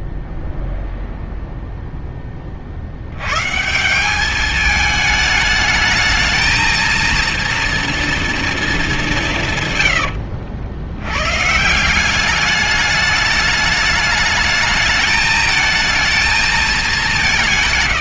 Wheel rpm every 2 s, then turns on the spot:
0, 80, 220, 230, 190, 110, 210, 220, 180.
none